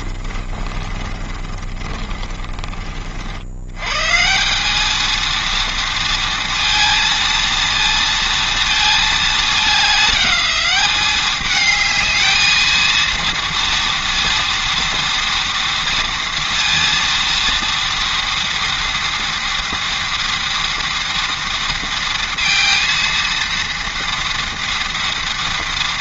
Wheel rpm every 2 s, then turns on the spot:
30, 40, 190, 230, 230, 200, 230, 230, 230, 240, 230, 230, 230.
0-2